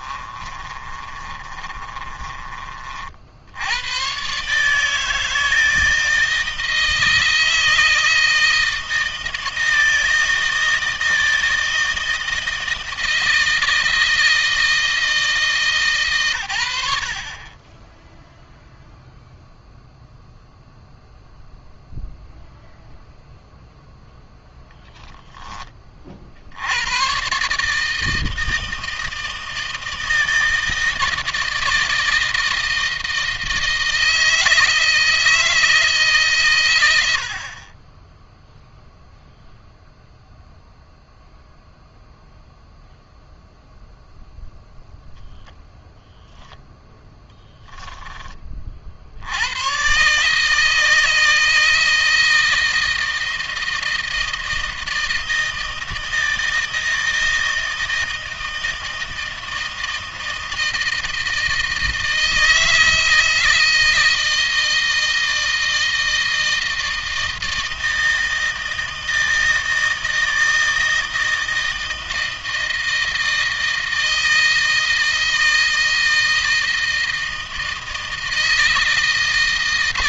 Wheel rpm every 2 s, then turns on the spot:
30, 40, 150, 160, 160, 160, 160, 160, 90, 0, 0, 0, 0, 80, 160, 160, 160, 160, 100, 0, 0, 0, 0, 0, 40, 160, 160, 160, 160, 160, 160, 160, 160, 160, 160, 160, 160, 160, 160, 160.
0-2